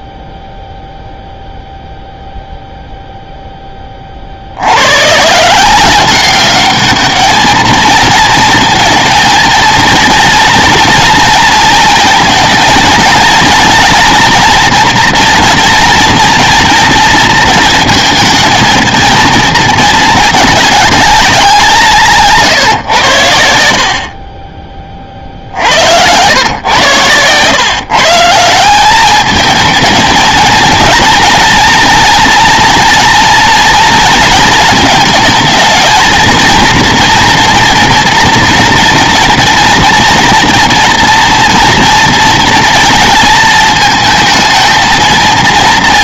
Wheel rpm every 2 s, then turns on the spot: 0, 0, 70, 200, 230, 230, 230, 240, 230, 220, 210, 150, 30, 120, 180, 230, 230, 220, 230, 240, 230, 230, 230.
none